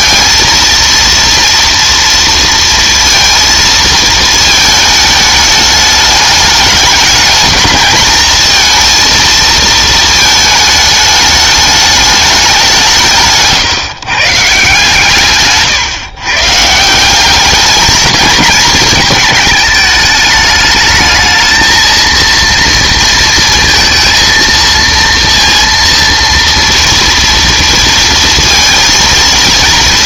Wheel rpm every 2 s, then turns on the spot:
230, 230, 220, 210, 230, 220, 180, 150, 150, 220, 210, 230, 230, 230, 230.
none